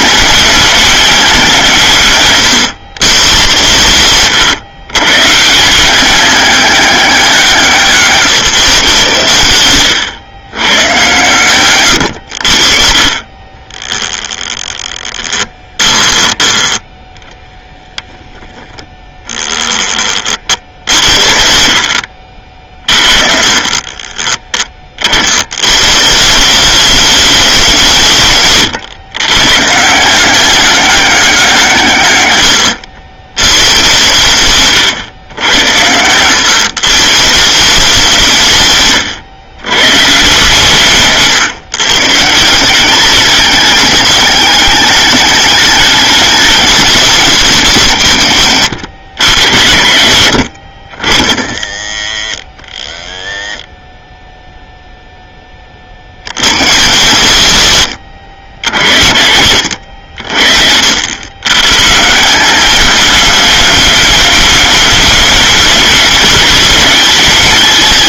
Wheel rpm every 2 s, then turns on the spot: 220, 130, 140, 190, 120, 120, 50, 20, 10, 10, 60, 30, 60, 200, 140, 190, 90, 100, 140, 120, 140, 200, 210, 190, 110, 90, 50, 10, 120, 80, 80, 210, 220, 210.
14-16 40-42